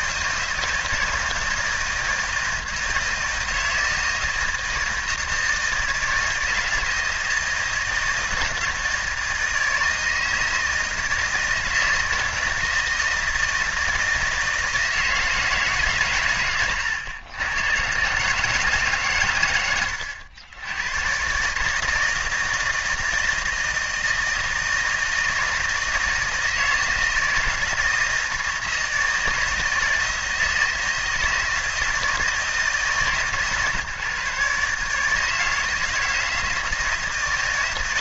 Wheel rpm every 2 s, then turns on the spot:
160, 160, 160, 160, 160, 160, 160, 160, 110, 150, 100, 160, 160, 160, 160, 160, 160, 150, 170.
none